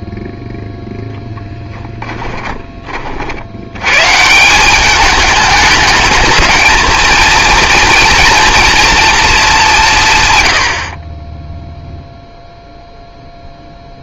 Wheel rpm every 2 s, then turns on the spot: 10, 50, 210, 230, 220, 30, 0.
none